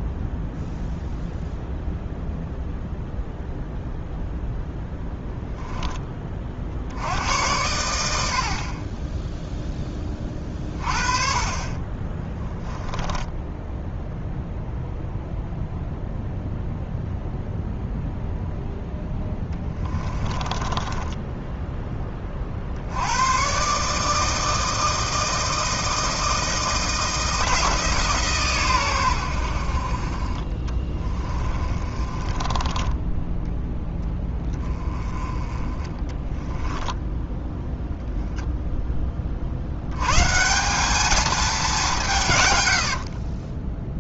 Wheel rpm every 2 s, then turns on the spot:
0, 0, 0, 70, 20, 40, 10, 0, 0, 0, 20, 80, 160, 170, 110, 20, 10, 20, 10, 20, 210, 70.
12-14 20-22 30-32 42-44